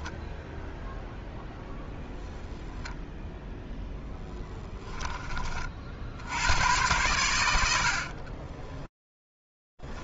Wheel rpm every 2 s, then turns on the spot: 0, 0, 10, 100, 20.
8-10